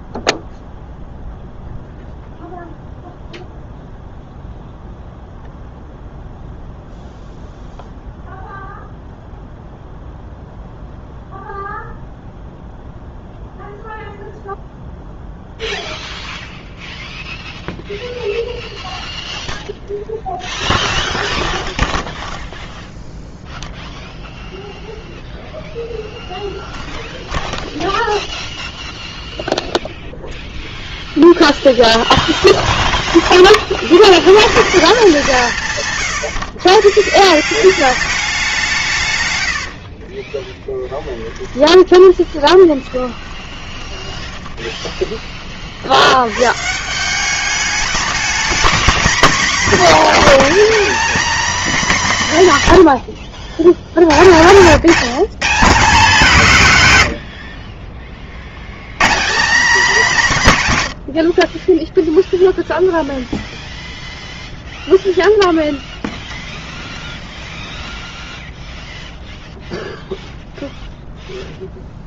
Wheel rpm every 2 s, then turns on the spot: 0, 0, 0, 0, 0, 0, 0, 0, 0, 0, 0, 0, 0, 0, 0, 0, 10, 170, 150, 140, 10, 20, 20, 170, 230, 270, 90, 180, 110, 140, 100, 0, 0, 20, 0, 0.
40-44